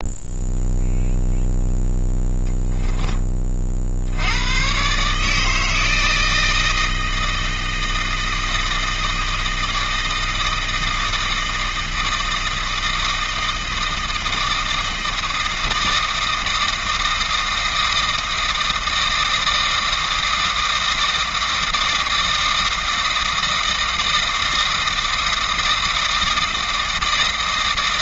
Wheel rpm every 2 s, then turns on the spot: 0, 10, 130, 160, 160, 160, 160, 160, 160, 160, 160, 160, 160, 160.
none